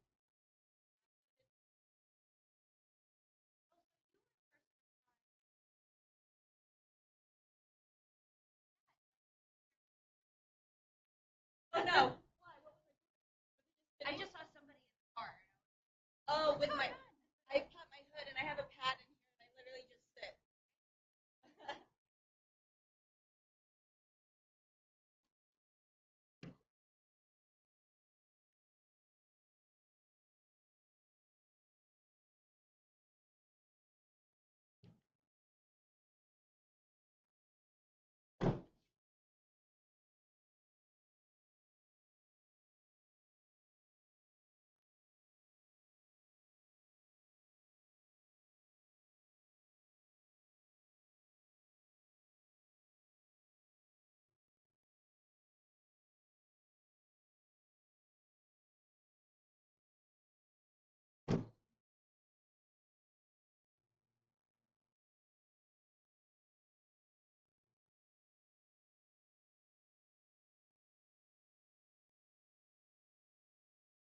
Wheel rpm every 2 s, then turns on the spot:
0, 0, 0, 0, 0, 0, 0, 0, 0, 0, 0, 0, 0, 0, 0, 0, 0, 0, 0, 0, 0, 0, 0, 0, 0, 0, 0, 0, 0, 0, 0, 0, 0, 0, 0, 0, 0.
none